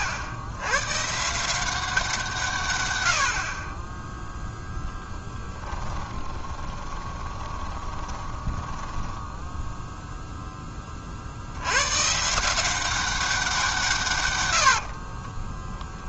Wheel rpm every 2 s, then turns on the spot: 100, 120, 0, 20, 10, 10, 180, 80.
6-10 14-16